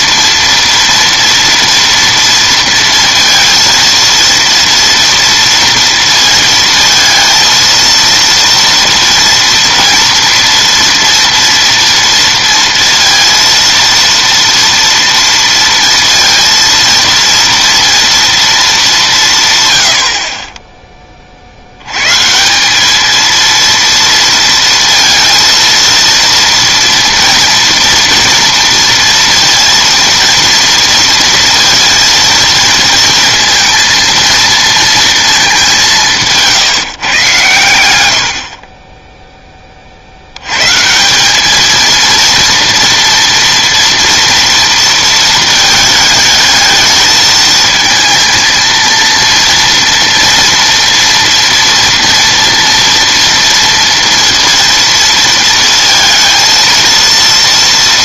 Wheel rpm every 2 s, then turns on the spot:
230, 230, 230, 230, 230, 230, 230, 230, 230, 210, 20, 190, 230, 240, 230, 230, 230, 230, 150, 40, 150, 230, 230, 220, 230, 230, 230, 230, 230.
none